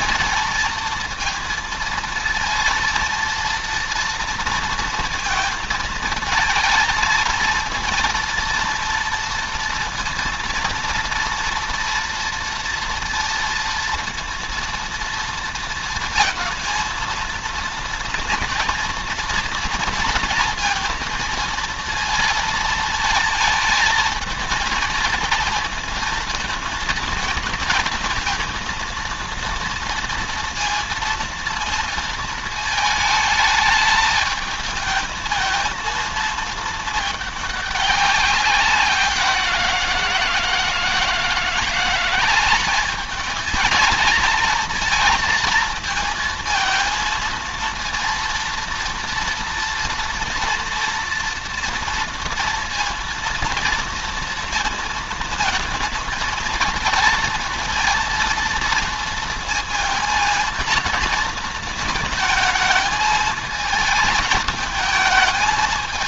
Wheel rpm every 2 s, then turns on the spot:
230, 230, 230, 220, 230, 230, 230, 230, 230, 230, 230, 220, 230, 220, 230, 230, 220, 220, 210, 180, 160, 210, 230, 230, 230, 230, 230, 230, 220, 230, 230, 220, 220.
none